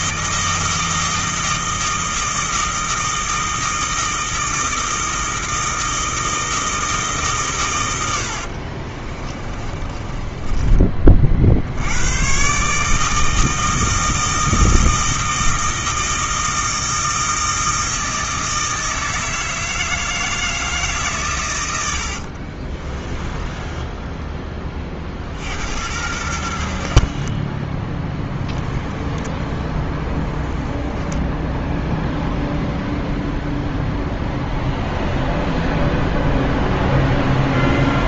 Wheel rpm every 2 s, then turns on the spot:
160, 160, 160, 160, 50, 20, 140, 160, 160, 160, 160, 40, 30, 70, 10, 10, 0, 0, 0.
8-12 22-24 28-30